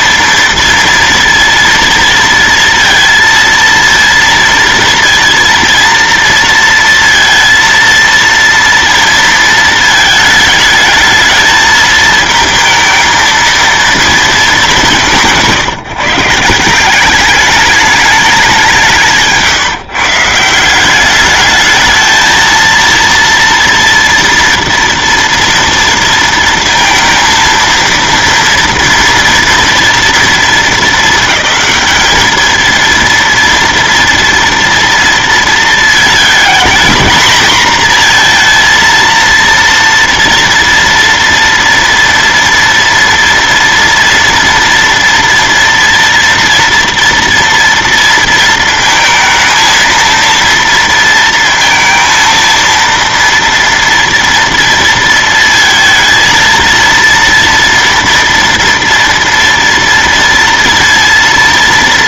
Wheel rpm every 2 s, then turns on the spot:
230, 230, 230, 230, 230, 220, 220, 210, 160, 200, 170, 220, 230, 230, 230, 230, 220, 230, 220, 230, 240, 230, 230, 230, 230, 230, 230, 230, 230, 230, 230.
none